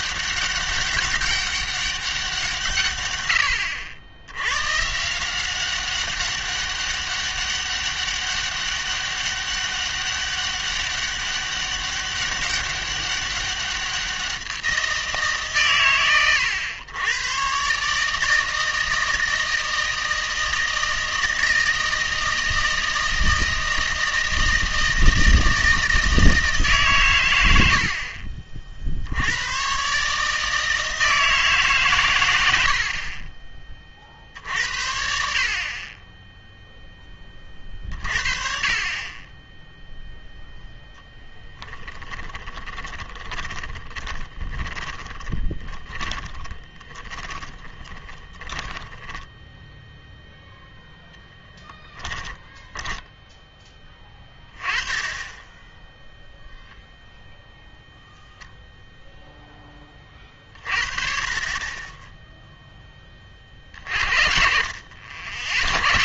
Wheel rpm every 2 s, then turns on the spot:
200, 150, 120, 200, 200, 200, 200, 180, 110, 160, 160, 160, 160, 150, 60, 160, 60, 80, 0, 30, 0, 20, 20, 20, 20, 0, 10, 20, 0, 0, 40, 10, 60.
42-50 52-54